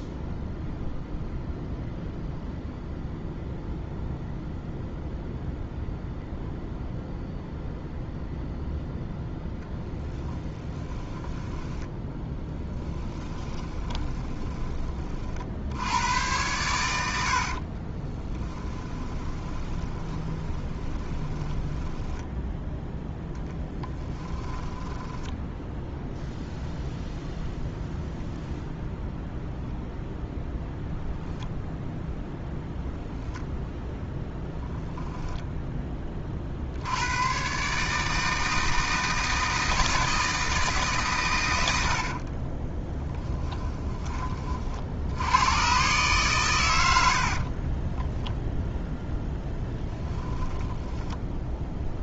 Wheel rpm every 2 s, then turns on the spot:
0, 0, 0, 0, 0, 10, 10, 30, 100, 20, 30, 10, 20, 0, 0, 0, 0, 0, 70, 160, 150, 10, 60, 110, 0, 10.
10-14 18-22 24-26 50-52